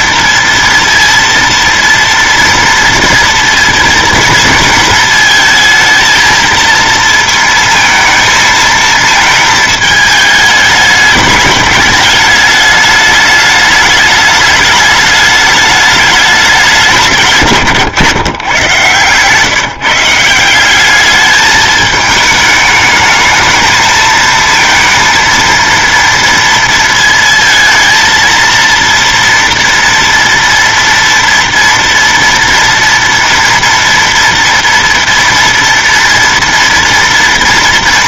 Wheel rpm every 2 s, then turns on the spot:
230, 230, 230, 230, 220, 210, 210, 210, 200, 130, 200, 220, 230, 230, 230, 230, 230, 230, 230.
none